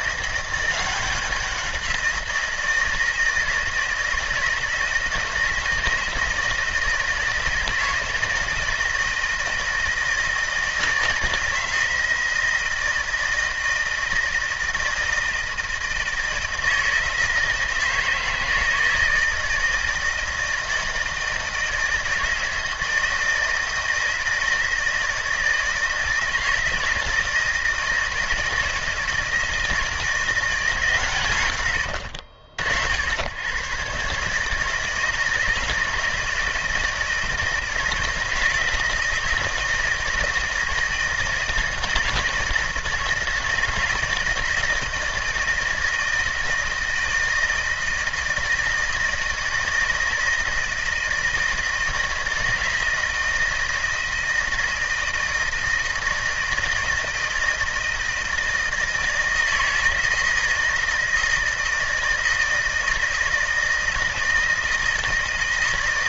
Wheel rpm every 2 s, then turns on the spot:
180, 170, 160, 160, 160, 160, 160, 160, 160, 160, 160, 160, 160, 160, 160, 150, 80, 160, 160, 160, 160, 160, 160, 160, 160, 160, 160, 160, 160, 160, 160, 160, 160.
none